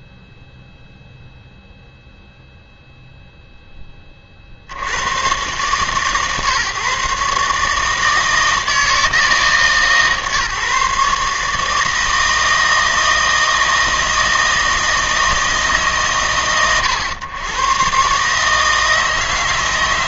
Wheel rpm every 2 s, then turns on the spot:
0, 0, 60, 150, 160, 140, 160, 160, 120, 150.
none